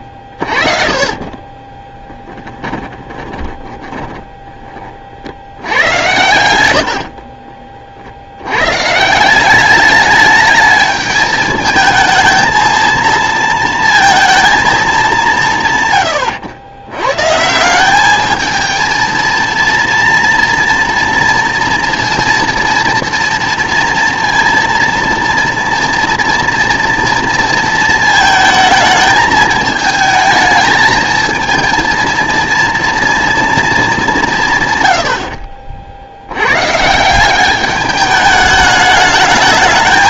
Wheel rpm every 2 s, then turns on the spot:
40, 10, 20, 80, 130, 210, 230, 220, 110, 220, 230, 230, 230, 230, 220, 220, 230, 120, 130, 210.
0-4 6-8